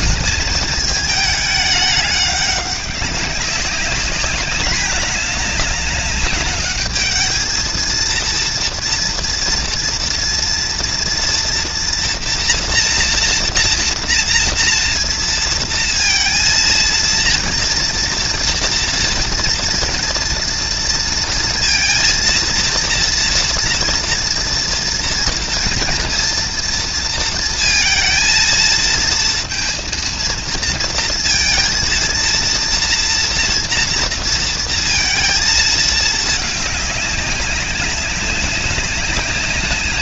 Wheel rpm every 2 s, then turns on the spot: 210, 190, 210, 210, 230, 230, 230, 230, 230, 230, 240, 230, 230, 230, 230, 230, 230, 230, 200, 190.
none